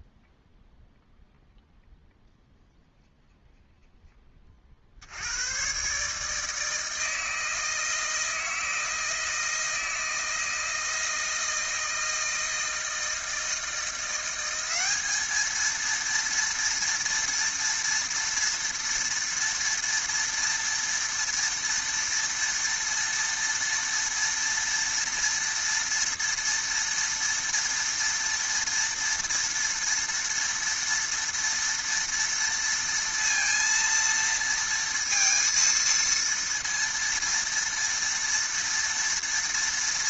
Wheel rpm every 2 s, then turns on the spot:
0, 0, 20, 150, 160, 160, 160, 180, 230, 230, 230, 230, 230, 230, 230, 230, 230, 230, 230, 230.
none